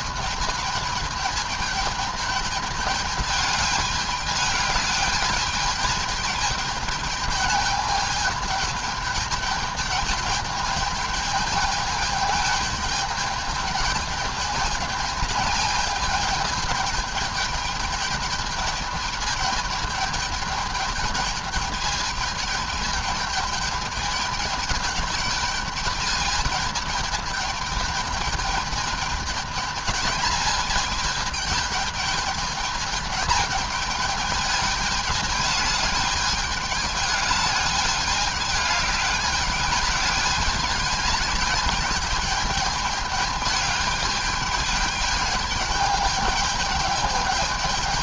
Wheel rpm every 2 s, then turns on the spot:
210, 210, 210, 210, 210, 210, 210, 210, 220, 210, 210, 210, 210, 210, 210, 220, 210, 210, 210, 200, 210, 210, 210, 210.
none